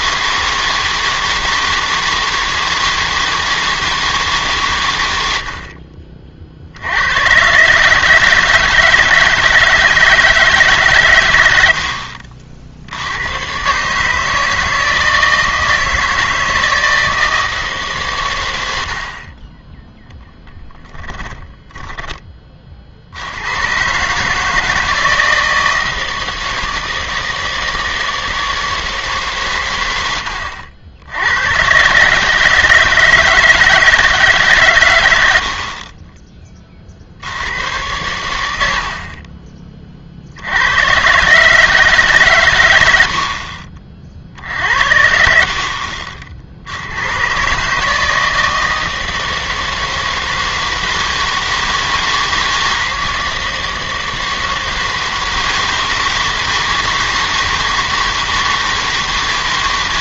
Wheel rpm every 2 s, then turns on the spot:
160, 160, 130, 60, 160, 150, 60, 160, 160, 100, 0, 30, 160, 160, 160, 80, 150, 130, 20, 70, 80, 120, 60, 70, 160, 160, 160, 160, 160, 160.
none